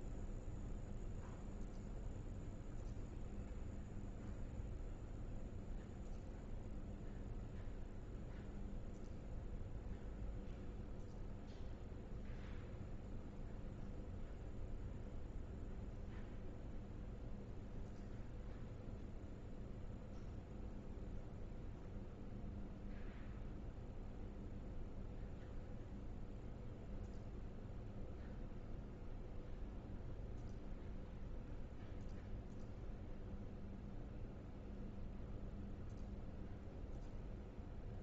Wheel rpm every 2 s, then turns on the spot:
0, 0, 0, 0, 0, 0, 0, 0, 0, 0, 0, 0, 0, 0, 0, 0, 0, 0, 0.
none